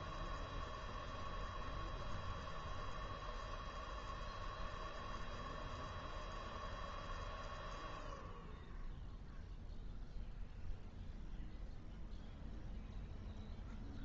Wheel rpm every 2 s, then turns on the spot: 0, 0, 0, 0, 0, 0, 0.
none